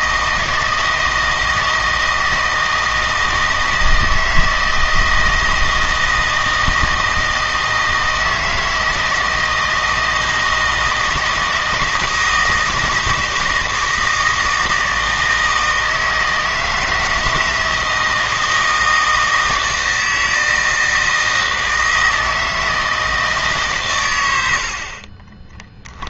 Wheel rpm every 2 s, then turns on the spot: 160, 160, 160, 160, 160, 160, 160, 160, 160, 160, 160, 160, 50.
none